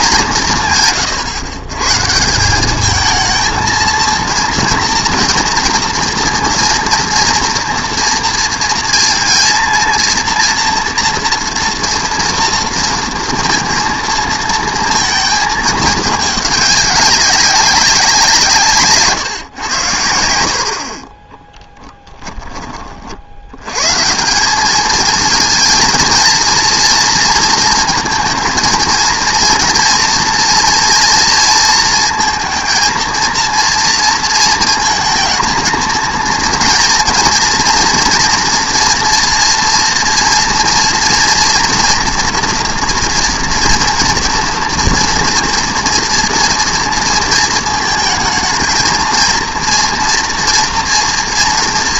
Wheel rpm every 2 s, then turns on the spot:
170, 190, 230, 230, 230, 230, 230, 220, 200, 170, 70, 20, 190, 230, 230, 230, 230, 230, 230, 230, 230, 230, 230, 240, 220, 240.
none